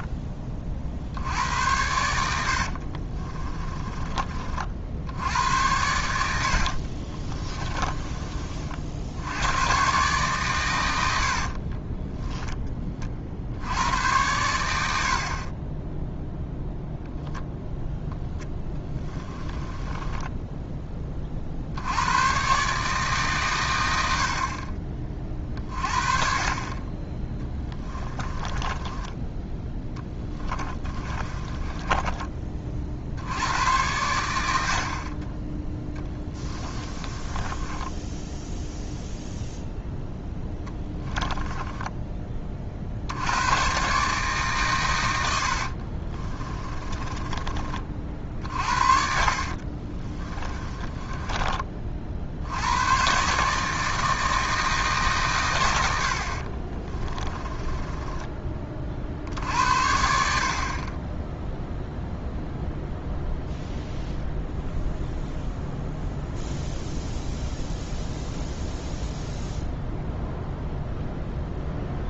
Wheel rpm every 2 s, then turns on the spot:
40, 70, 50, 60, 50, 100, 20, 90, 0, 10, 10, 140, 30, 20, 20, 20, 40, 70, 20, 0, 10, 50, 120, 20, 50, 20, 90, 160, 40, 50, 40, 0, 0, 0, 0, 0.
2-4 6-8 18-20 28-32 36-38 40-42 46-52 56-58